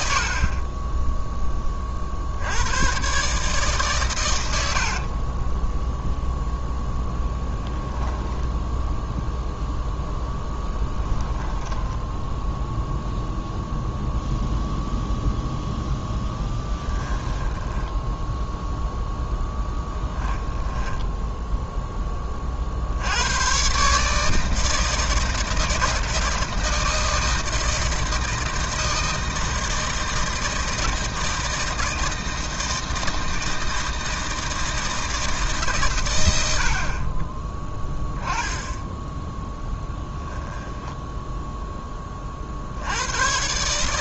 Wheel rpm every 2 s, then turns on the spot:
20, 110, 60, 10, 0, 10, 0, 0, 10, 0, 10, 70, 160, 160, 160, 160, 160, 160, 30, 10, 0, 90.
4-6 10-12 16-18 20-22